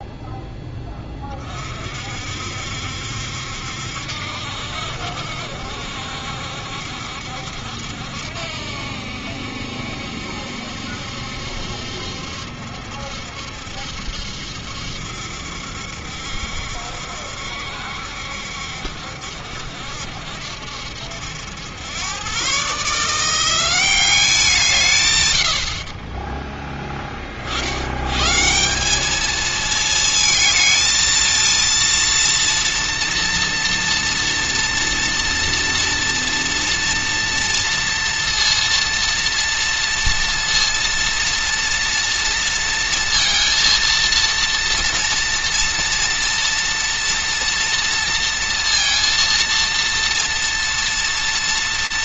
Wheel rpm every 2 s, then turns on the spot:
10, 60, 70, 60, 70, 70, 70, 70, 70, 60, 70, 140, 160, 10, 180, 230, 230, 230, 230, 230, 230, 230, 230, 230, 230, 230.
none